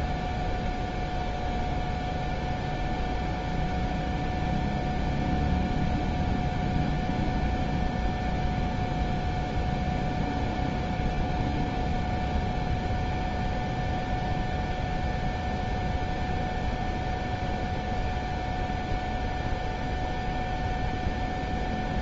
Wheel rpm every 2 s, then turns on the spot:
0, 0, 0, 0, 0, 0, 0, 0, 0, 0, 0.
none